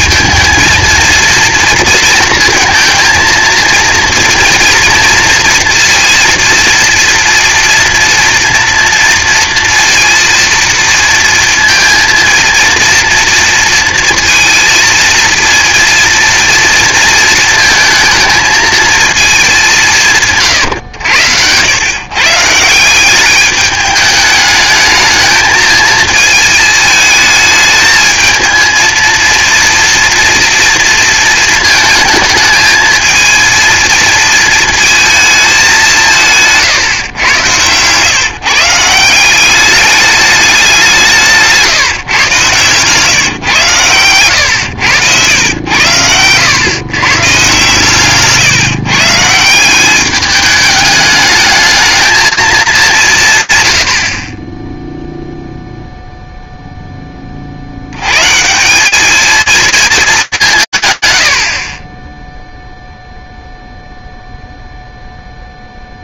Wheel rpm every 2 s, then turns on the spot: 230, 230, 230, 230, 230, 230, 230, 230, 230, 220, 110, 170, 210, 220, 220, 230, 220, 220, 140, 160, 180, 130, 110, 130, 150, 210, 180, 0, 0, 190, 180, 10, 0.
36-38